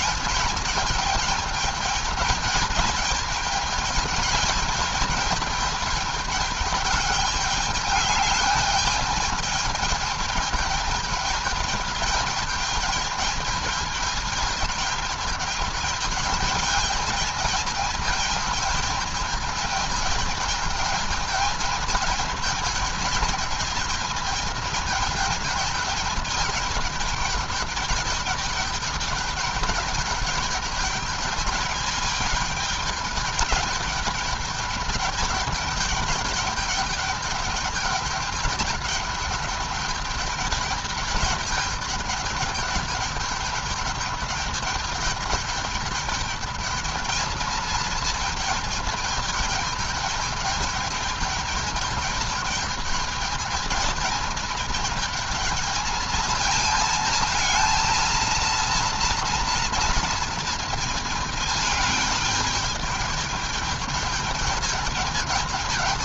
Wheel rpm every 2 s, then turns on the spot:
210, 220, 210, 210, 210, 210, 210, 220, 210, 220, 220, 220, 220, 210, 210, 210, 210, 210, 210, 210, 210, 210, 210, 220, 220, 210, 210, 220, 230, 230, 220, 210, 210.
none